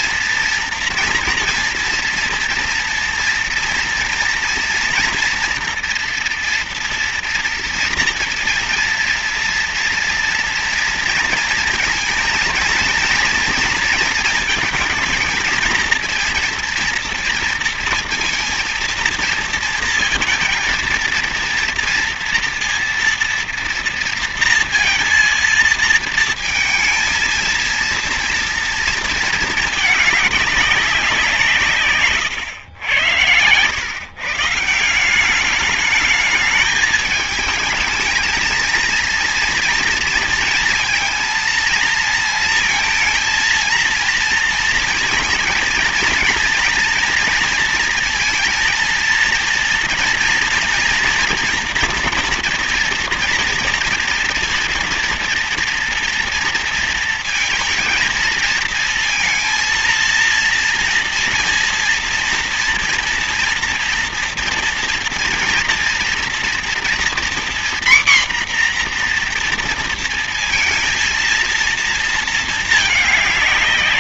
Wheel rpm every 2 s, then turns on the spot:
230, 230, 230, 240, 230, 230, 230, 230, 230, 230, 230, 230, 230, 230, 230, 210, 120, 130, 210, 220, 230, 230, 230, 230, 230, 230, 240, 230, 230, 230, 230, 230, 230, 240, 250, 230, 220.
none